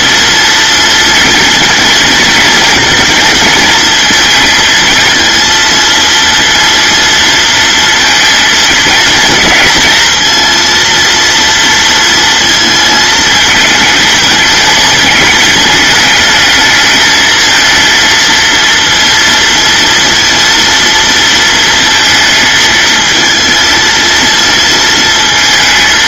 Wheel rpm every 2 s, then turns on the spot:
230, 230, 230, 230, 230, 230, 220, 220, 220, 230, 230, 220, 230.
none